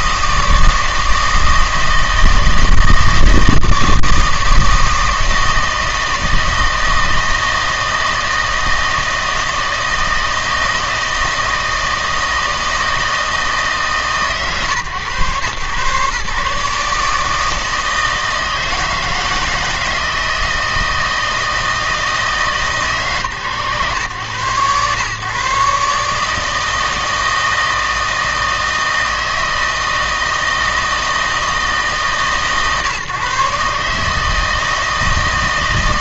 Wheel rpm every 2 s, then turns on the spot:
160, 160, 160, 160, 160, 160, 160, 140, 150, 160, 160, 140, 110, 160, 160, 160, 140, 150.
none